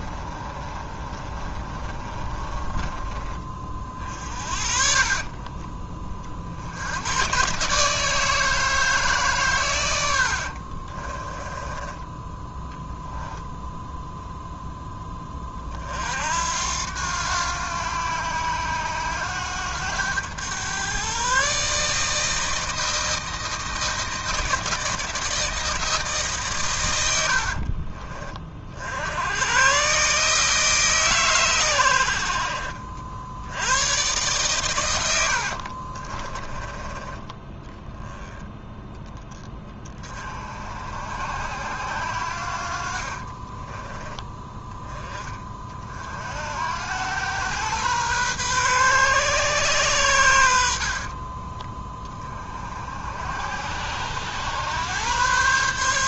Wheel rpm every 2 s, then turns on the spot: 30, 20, 40, 70, 160, 50, 10, 0, 80, 90, 120, 160, 160, 130, 50, 150, 50, 120, 20, 10, 60, 60, 10, 80, 130, 60, 50, 110.
0-4 10-12 36-38 50-52